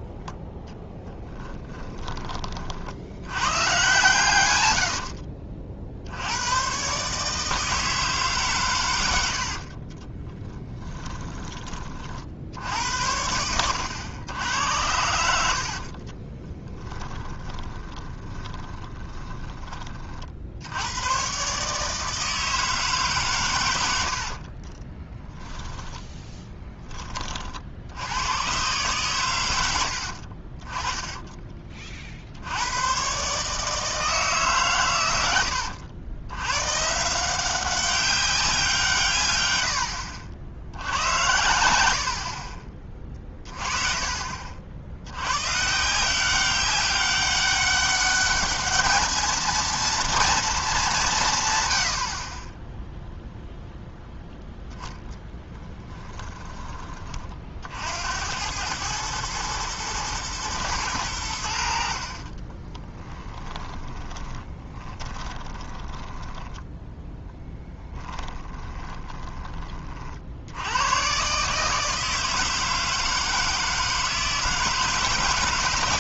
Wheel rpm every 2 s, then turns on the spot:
10, 60, 70, 130, 120, 30, 80, 90, 20, 10, 80, 150, 30, 10, 130, 20, 100, 130, 140, 170, 80, 30, 60, 200, 210, 210, 10, 0, 20, 100, 110, 20, 20, 10, 20, 100, 160, 160.
0-2 10-12 16-20 24-26 62-66 68-70